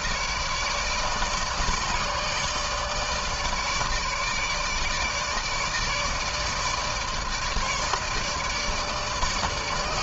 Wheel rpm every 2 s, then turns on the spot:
150, 160, 150, 150, 150.
none